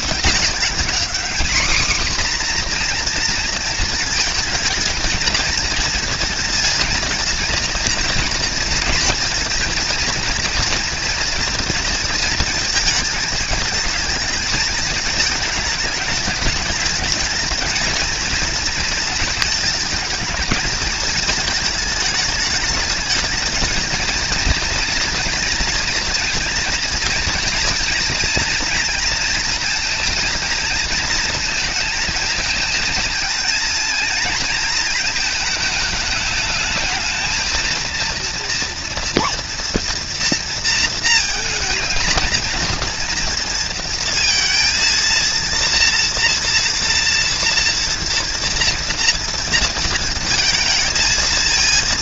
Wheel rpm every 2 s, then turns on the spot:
200, 250, 220, 230, 230, 230, 230, 220, 210, 220, 230, 220, 230, 240, 230, 230, 220, 220, 210, 230, 230, 230, 230, 230, 230, 230.
none